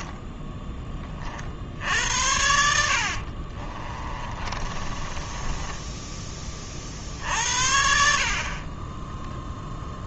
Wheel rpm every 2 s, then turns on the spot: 20, 50, 20, 50, 20.
2-6